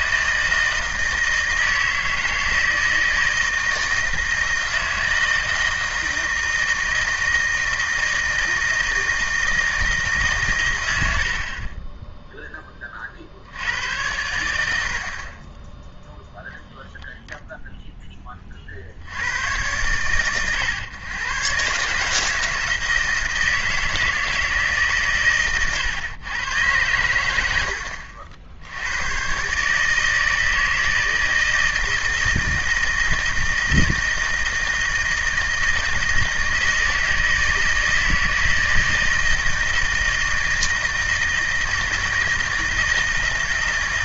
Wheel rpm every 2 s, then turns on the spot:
170, 160, 160, 160, 160, 110, 30, 50, 0, 40, 120, 160, 140, 100, 90, 160, 160, 160, 160, 160, 160, 160.
none